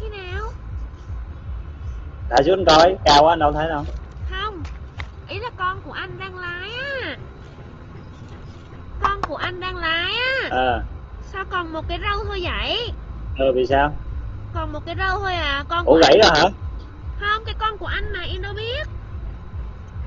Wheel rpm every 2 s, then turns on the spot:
0, 0, 0, 0, 0, 0, 0, 0, 0, 0.
none